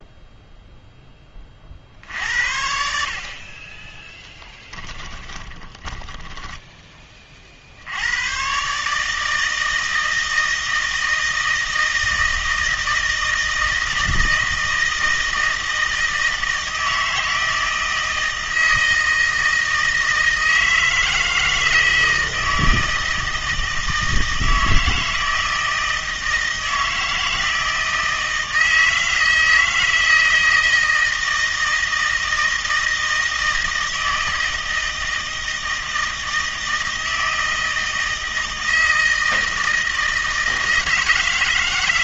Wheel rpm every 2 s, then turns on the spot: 0, 60, 10, 10, 140, 160, 160, 160, 160, 160, 160, 160, 160, 160, 160, 160, 160, 160, 160, 160, 160.
4-6